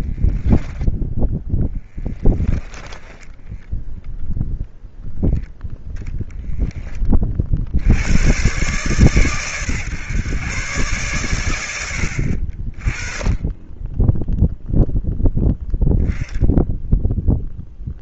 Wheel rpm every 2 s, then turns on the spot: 10, 10, 0, 30, 130, 110, 20, 0, 0.
2-4